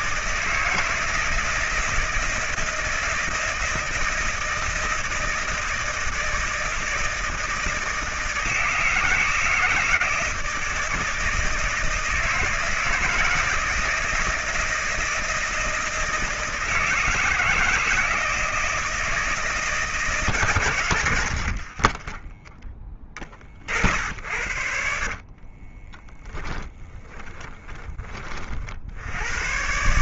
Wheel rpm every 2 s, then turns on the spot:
160, 160, 160, 160, 160, 160, 160, 160, 160, 160, 120, 20, 70, 20, 70.
24-28